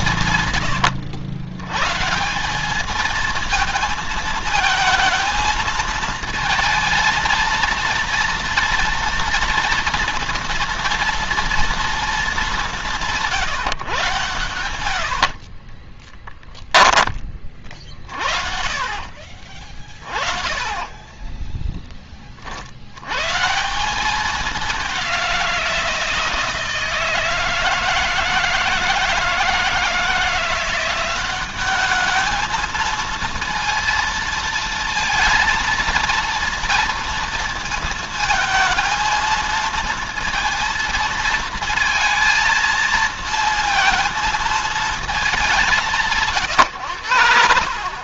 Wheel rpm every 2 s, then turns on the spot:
100, 210, 220, 230, 230, 230, 190, 90, 20, 50, 30, 90, 190, 160, 160, 180, 220, 230, 230, 230, 230, 230, 220, 110.
0-2 14-16 18-22